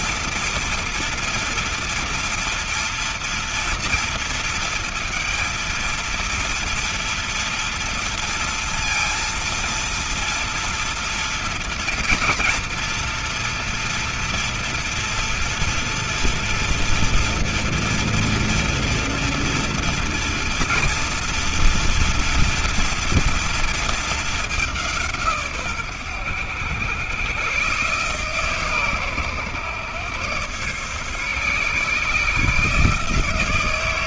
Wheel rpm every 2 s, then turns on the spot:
230, 230, 230, 230, 230, 230, 230, 230, 230, 230, 230, 230, 200, 100, 130, 130, 150.
none